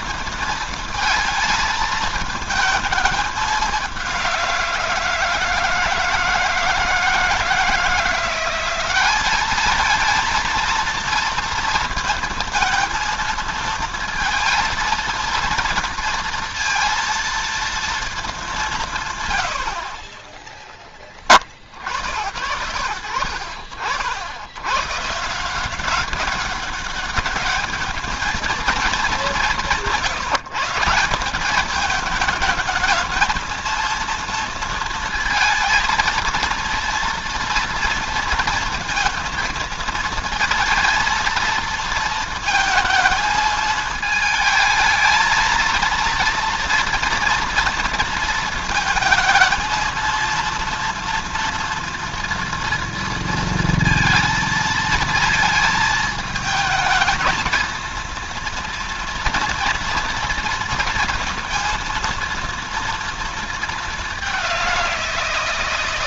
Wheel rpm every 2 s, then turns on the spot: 220, 220, 170, 160, 190, 230, 230, 230, 230, 160, 10, 70, 130, 200, 210, 160, 220, 230, 230, 230, 230, 220, 220, 230, 230, 230, 230, 230, 220, 240, 230, 230, 180.
none